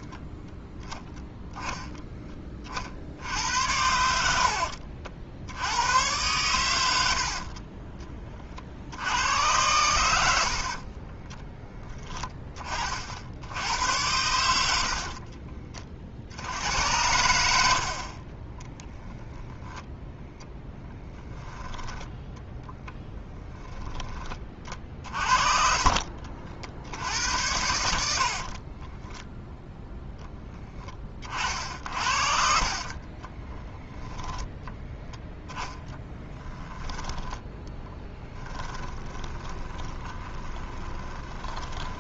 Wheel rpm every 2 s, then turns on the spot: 0, 20, 70, 110, 50, 40, 20, 80, 90, 20, 0, 0, 30, 70, 40, 10, 50, 10, 10, 10, 20.
4-6 24-26 28-30 32-34 38-42